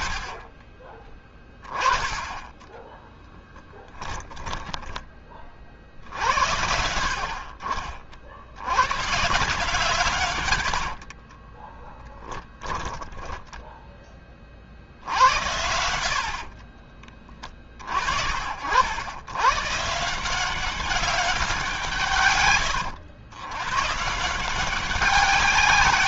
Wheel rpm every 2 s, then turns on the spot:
30, 30, 20, 80, 80, 110, 10, 40, 50, 60, 180, 130, 170.
2-6 10-14 16-18